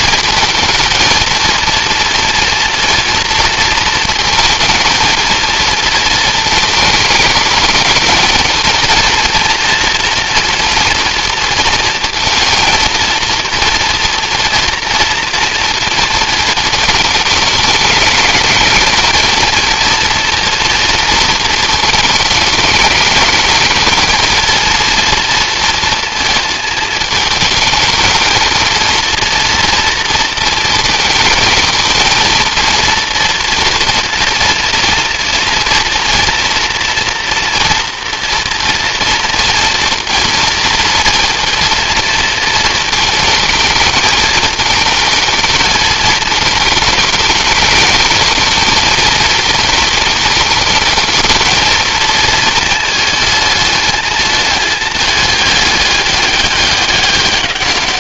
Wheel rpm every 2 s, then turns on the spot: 230, 230, 230, 220, 230, 230, 230, 230, 220, 230, 230, 220, 230, 220, 230, 220, 230, 230, 230, 240, 230, 220, 220, 210, 230, 230, 220, 210, 200.
none